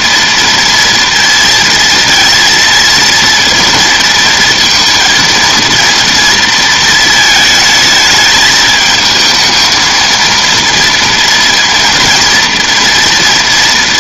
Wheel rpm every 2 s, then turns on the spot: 230, 230, 230, 220, 220, 230, 230.
none